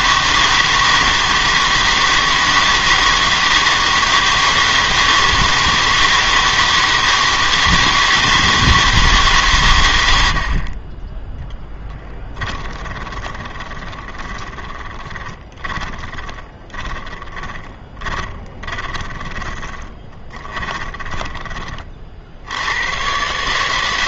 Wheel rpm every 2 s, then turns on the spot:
160, 160, 160, 160, 160, 40, 20, 20, 30, 20, 20, 90.
12-22